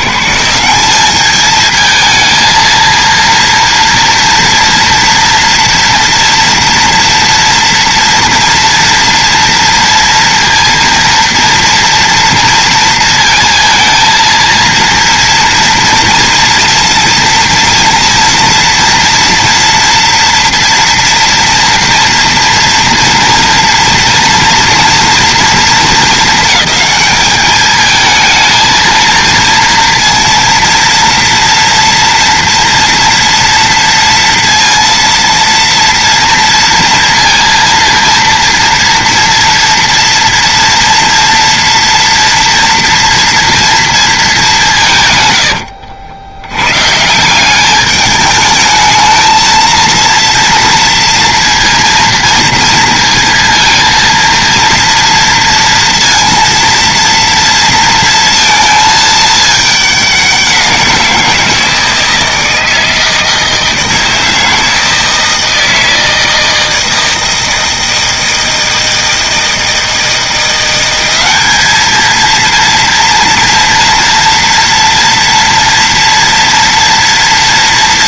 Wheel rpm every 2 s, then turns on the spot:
190, 230, 230, 230, 230, 230, 230, 230, 230, 240, 240, 230, 230, 220, 230, 230, 230, 230, 230, 230, 230, 230, 170, 120, 220, 230, 230, 230, 230, 220, 180, 160, 160, 160, 160, 180, 230, 230, 230.
none